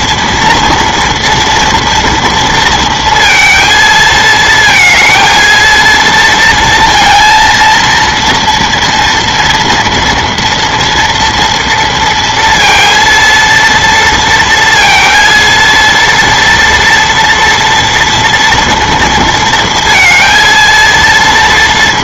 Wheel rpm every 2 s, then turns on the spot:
230, 230, 220, 230, 230, 230, 230, 230, 230, 230, 230.
none